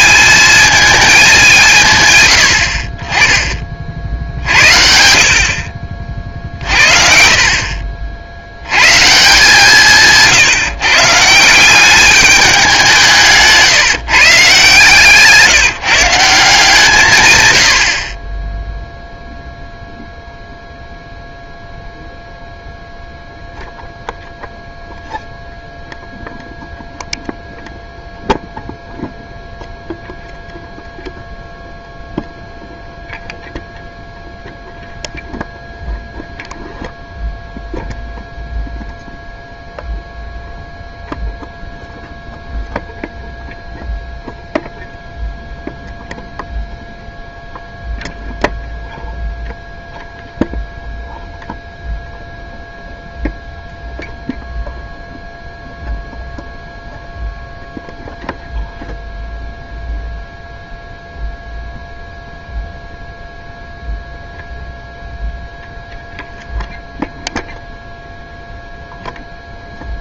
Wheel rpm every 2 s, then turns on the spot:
210, 80, 60, 50, 90, 150, 190, 140, 170, 20, 0, 0, 0, 0, 0, 0, 0, 0, 0, 0, 0, 0, 0, 0, 0, 0, 0, 0, 0, 0, 0, 0, 0, 0, 0.
6-8